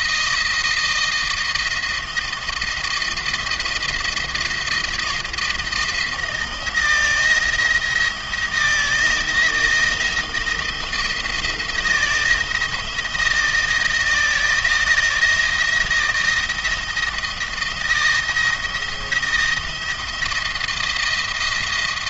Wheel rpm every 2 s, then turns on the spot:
170, 170, 170, 170, 170, 160, 160, 160, 170, 170, 170.
none